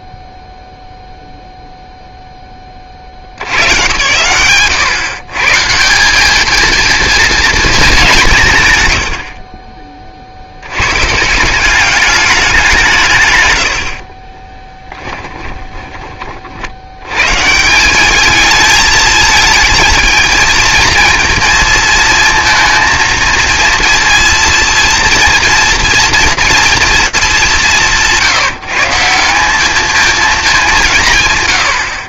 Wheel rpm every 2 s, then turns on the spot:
0, 40, 130, 230, 110, 120, 160, 10, 80, 220, 230, 230, 240, 230, 170, 170.
14-16